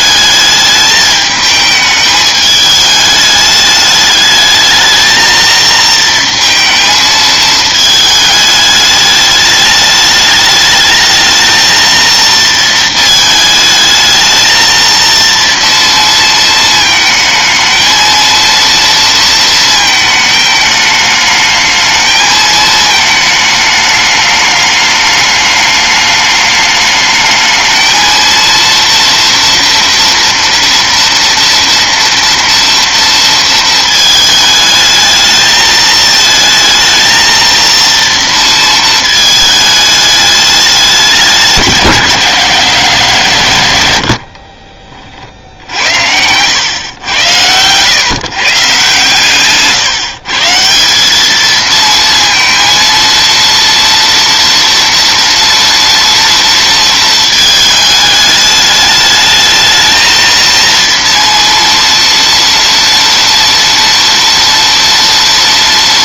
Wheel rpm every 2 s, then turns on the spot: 210, 210, 220, 220, 210, 210, 220, 230, 220, 230, 210, 220, 210, 210, 230, 230, 230, 220, 230, 220, 200, 160, 40, 110, 150, 190, 230, 230, 220, 210, 230, 230, 230.
none